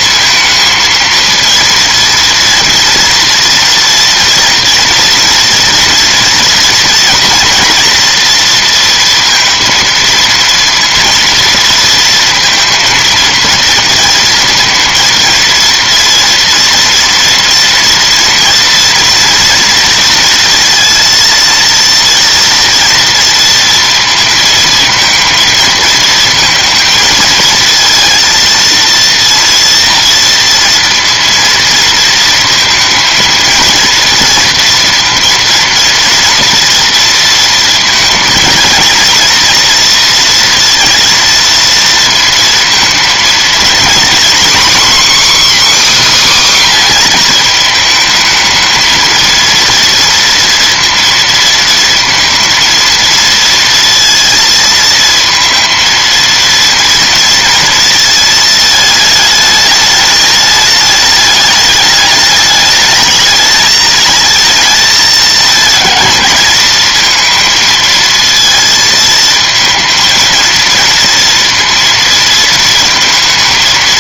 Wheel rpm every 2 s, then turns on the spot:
230, 230, 230, 230, 230, 230, 230, 220, 230, 230, 230, 240, 230, 230, 230, 230, 230, 230, 230, 230, 230, 230, 260, 260, 230, 230, 230, 230, 230, 220, 210, 210, 220, 220, 220, 230, 230.
none